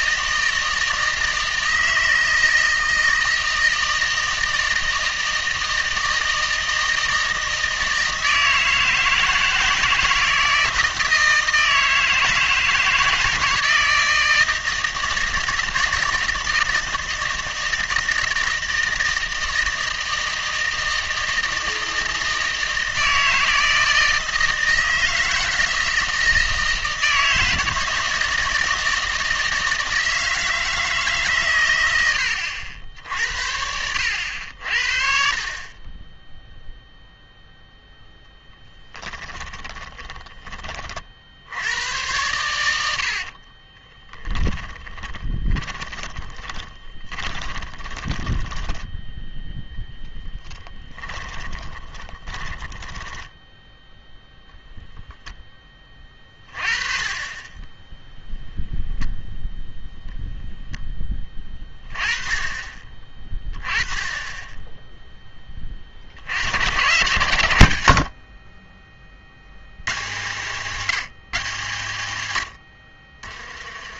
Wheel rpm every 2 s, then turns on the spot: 160, 160, 160, 160, 160, 160, 160, 160, 160, 160, 160, 160, 160, 160, 160, 160, 70, 50, 0, 10, 30, 80, 30, 20, 10, 10, 10, 0, 30, 0, 10, 20, 10, 110, 30, 160, 80.
38-40 44-54